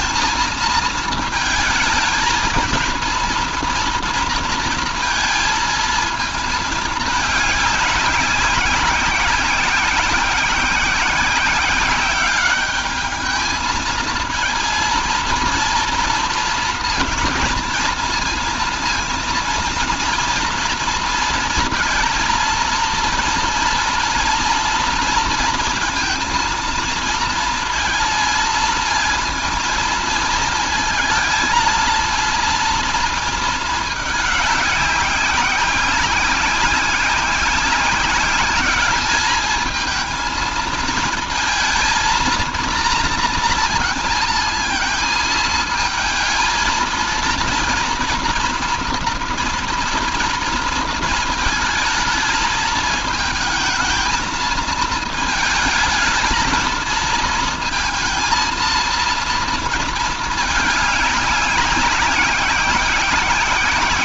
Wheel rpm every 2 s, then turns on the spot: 220, 230, 230, 210, 190, 190, 210, 230, 230, 230, 230, 230, 230, 230, 230, 220, 230, 200, 190, 200, 220, 230, 230, 230, 230, 230, 220, 220, 230, 230, 210, 190.
none